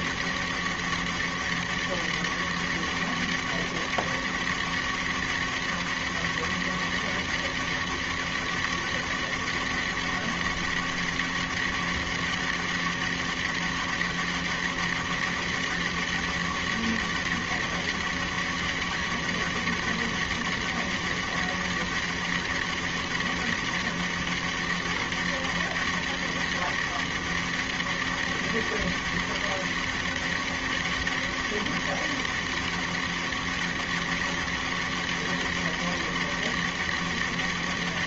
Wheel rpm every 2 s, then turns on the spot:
200, 200, 200, 200, 200, 200, 200, 200, 200, 200, 200, 200, 200, 200, 200, 200, 200, 200, 200.
none